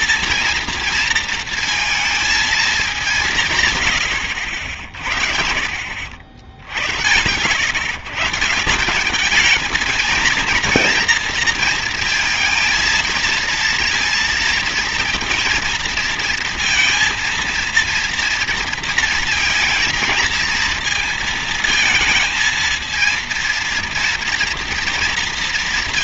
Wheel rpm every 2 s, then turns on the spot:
230, 210, 70, 100, 180, 230, 220, 230, 230, 230, 230, 220, 240.
none